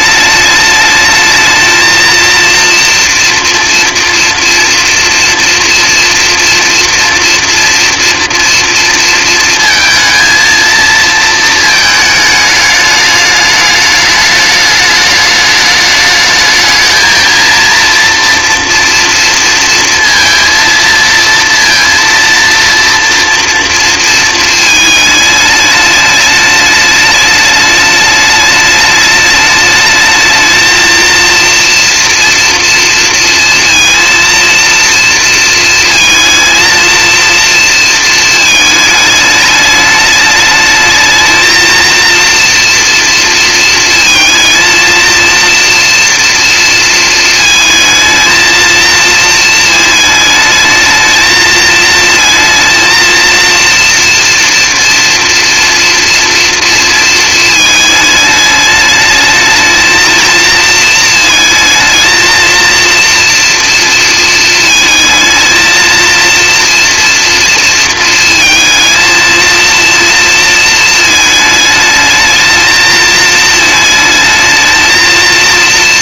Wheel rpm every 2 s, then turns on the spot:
210, 240, 240, 230, 230, 220, 210, 210, 220, 230, 230, 230, 220, 210, 210, 230, 230, 230, 220, 220, 220, 230, 230, 230, 230, 220, 230, 230, 230, 210, 230, 230, 220, 230, 230, 220, 220, 220.
none